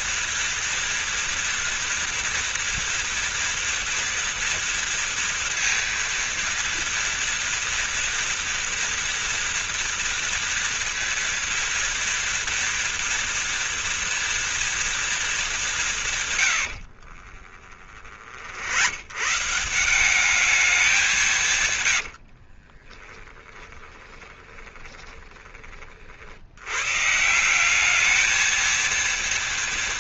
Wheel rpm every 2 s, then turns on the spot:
230, 230, 230, 230, 230, 230, 230, 230, 110, 50, 200, 70, 20, 70, 220.
22-26